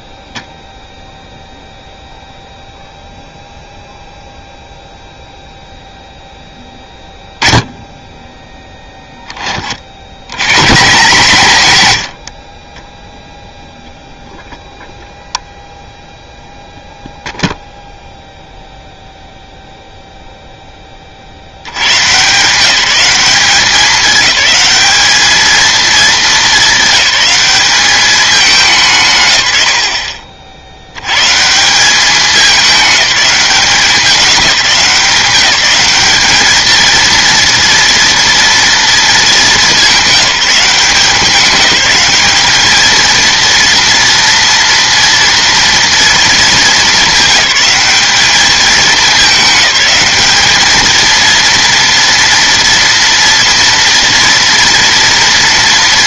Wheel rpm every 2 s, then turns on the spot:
0, 0, 0, 10, 10, 140, 30, 0, 0, 0, 10, 170, 210, 210, 190, 70, 210, 190, 220, 230, 180, 210, 230, 220, 210, 220, 230, 230.
none